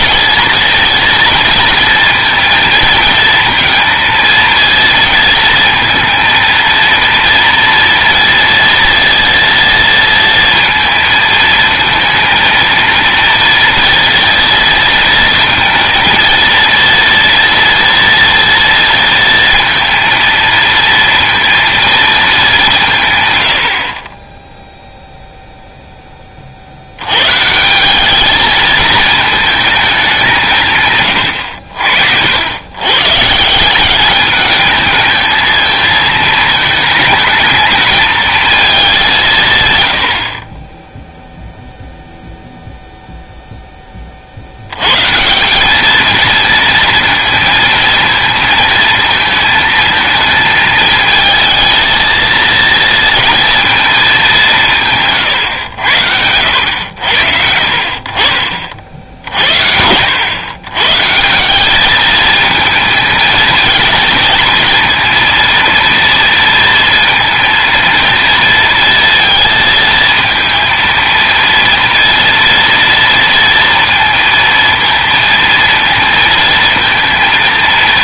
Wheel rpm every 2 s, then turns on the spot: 230, 230, 230, 230, 230, 230, 230, 230, 230, 230, 230, 170, 0, 60, 220, 150, 110, 220, 220, 210, 10, 0, 100, 230, 230, 220, 230, 170, 90, 50, 130, 220, 230, 230, 230, 230, 230, 230, 230.
54-56